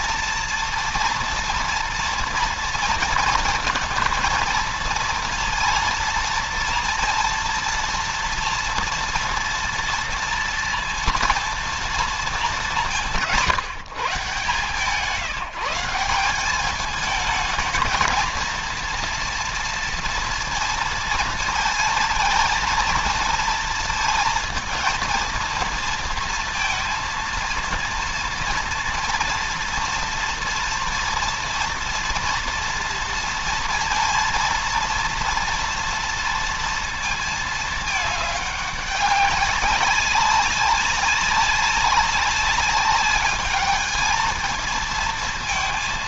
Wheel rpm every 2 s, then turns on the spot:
230, 230, 230, 230, 230, 230, 190, 160, 210, 230, 230, 230, 230, 230, 230, 230, 230, 230, 220, 200, 190, 200, 220.
none